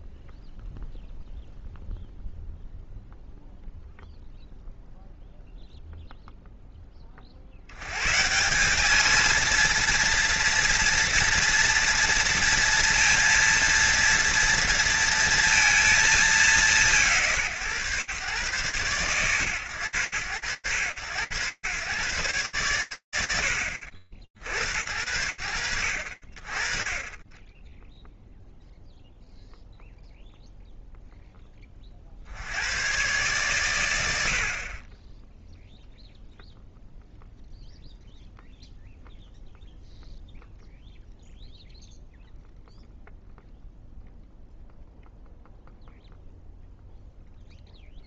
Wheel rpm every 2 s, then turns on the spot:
0, 0, 0, 40, 220, 230, 230, 230, 140, 130, 100, 100, 70, 20, 0, 10, 120, 10, 0, 0, 0, 0, 0, 0.
none